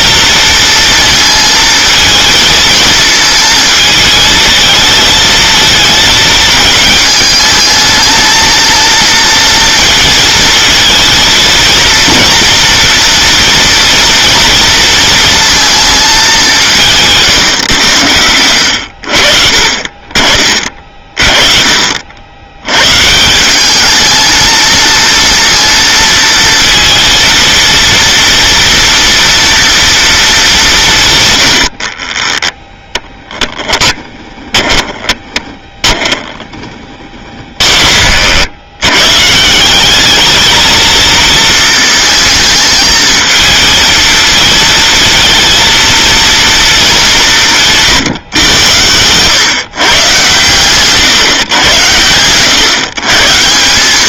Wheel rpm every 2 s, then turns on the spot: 230, 220, 220, 220, 230, 220, 230, 230, 170, 70, 40, 110, 230, 230, 230, 200, 20, 20, 20, 100, 220, 220, 220, 220, 110, 130, 130.
32-38